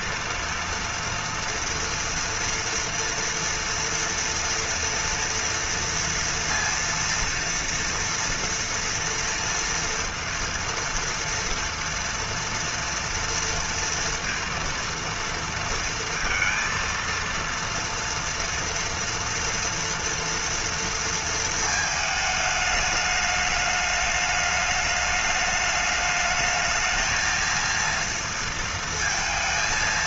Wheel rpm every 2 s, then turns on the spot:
230, 230, 230, 230, 230, 230, 230, 230, 230, 230, 230, 210, 210, 220, 230.
none